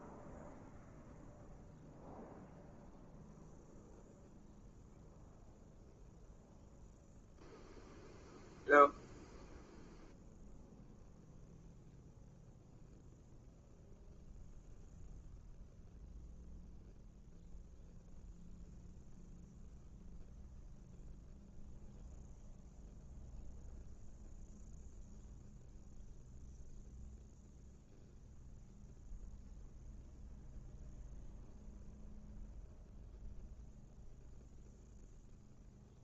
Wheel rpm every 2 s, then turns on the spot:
0, 0, 0, 0, 0, 0, 0, 0, 0, 0, 0, 0, 0, 0, 0, 0, 0, 0.
none